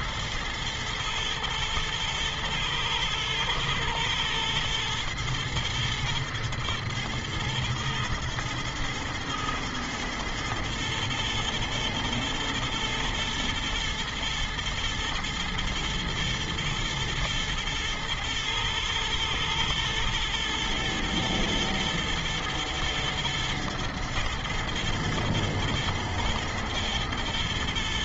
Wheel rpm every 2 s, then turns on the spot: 120, 110, 110, 120, 120, 120, 120, 110, 110, 110, 120, 110, 120, 120.
none